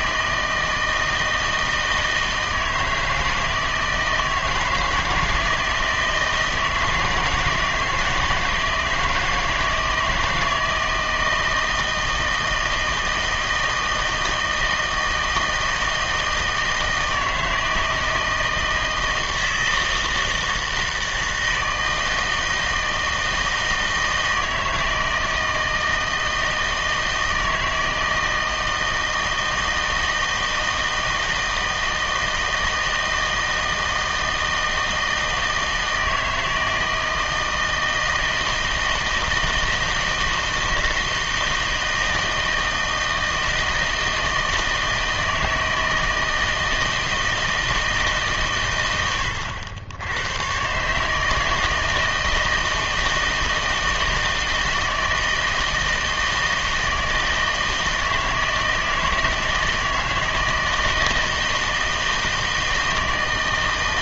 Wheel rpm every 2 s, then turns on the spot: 160, 160, 160, 160, 160, 160, 160, 160, 160, 160, 160, 160, 160, 160, 160, 160, 160, 160, 160, 160, 160, 160, 160, 160, 110, 140, 160, 160, 160, 160, 160, 160.
none